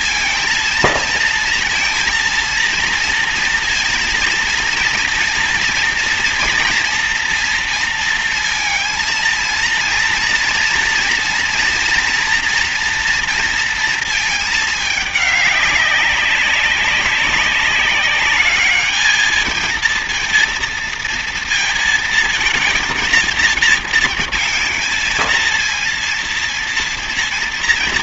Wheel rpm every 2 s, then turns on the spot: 230, 230, 230, 230, 230, 240, 240, 220, 200, 210, 230, 230, 230, 230.
none